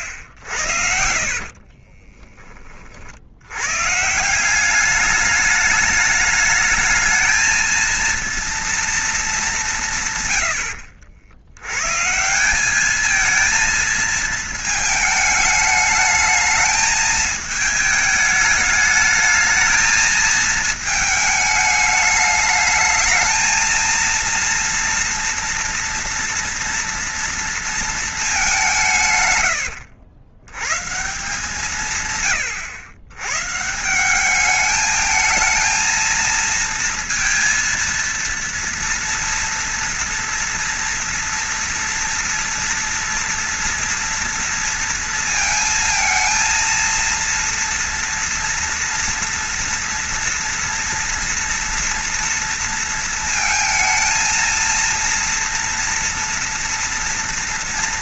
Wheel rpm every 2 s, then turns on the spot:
70, 20, 190, 210, 230, 100, 190, 220, 220, 210, 220, 210, 230, 230, 190, 120, 100, 210, 230, 230, 240, 230, 230, 230, 230, 230, 230, 230, 230.
none